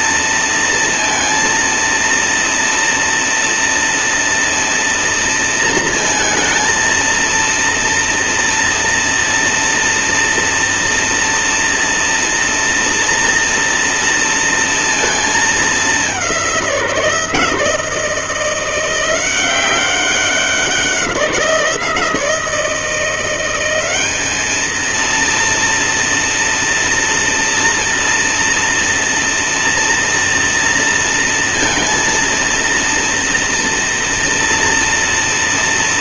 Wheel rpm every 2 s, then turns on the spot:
230, 230, 230, 230, 230, 240, 230, 230, 170, 170, 180, 170, 230, 230, 230, 230, 230, 230.
none